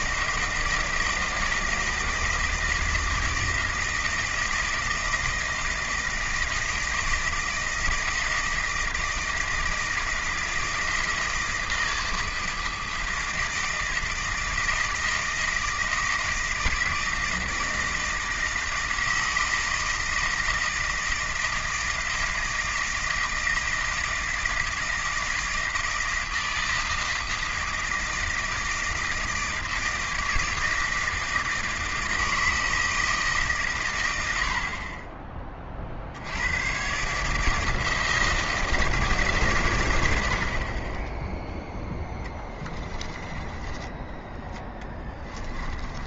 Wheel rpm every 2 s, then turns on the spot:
160, 160, 160, 160, 160, 160, 160, 160, 160, 160, 160, 160, 160, 160, 160, 160, 160, 60, 110, 160, 60, 10, 10.
40-44